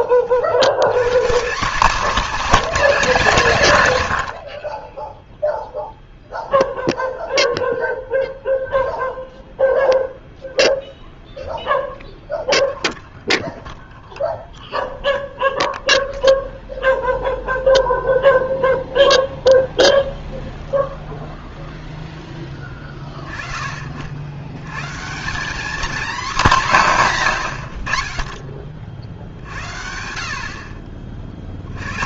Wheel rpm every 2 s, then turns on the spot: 50, 270, 40, 0, 0, 0, 0, 0, 0, 0, 0, 20, 80, 190, 40, 50.
none